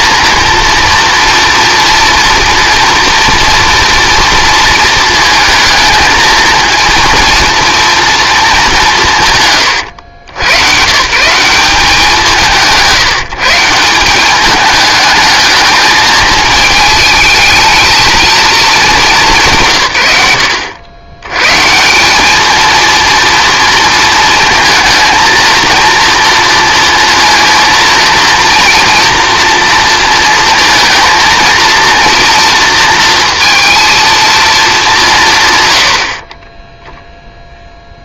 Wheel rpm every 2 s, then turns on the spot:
230, 230, 230, 230, 210, 110, 160, 210, 220, 220, 90, 230, 220, 230, 230, 230, 230, 220, 20.
36-38